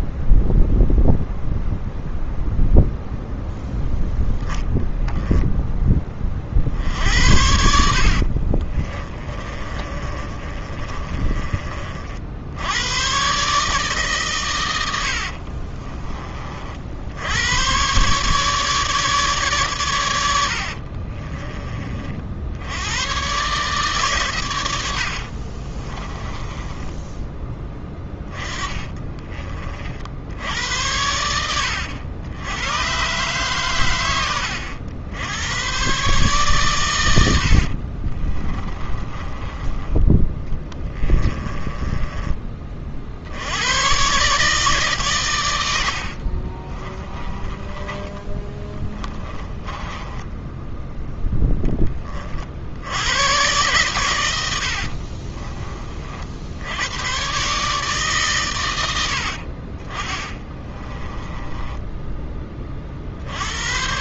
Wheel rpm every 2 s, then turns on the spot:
0, 0, 0, 60, 30, 30, 100, 100, 70, 150, 50, 100, 80, 10, 20, 90, 120, 80, 110, 20, 20, 40, 140, 30, 10, 10, 90, 60, 100, 90, 20, 40.
6-12 14-16 20-22 24-30 38-42 46-50 54-56 60-62